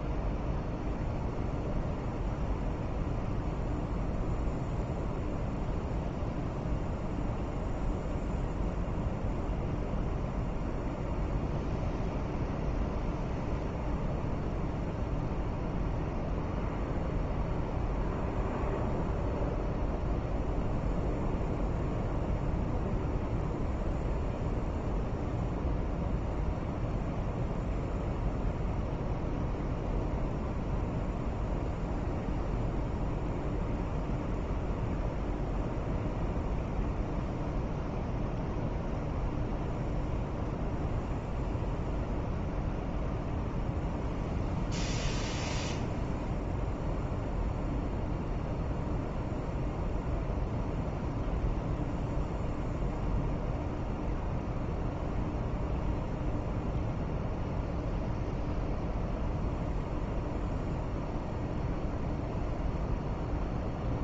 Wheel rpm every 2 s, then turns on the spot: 0, 0, 0, 0, 0, 0, 0, 0, 0, 0, 0, 0, 0, 0, 0, 0, 0, 0, 0, 0, 0, 0, 0, 0, 0, 0, 0, 0, 0, 0, 0, 0.
none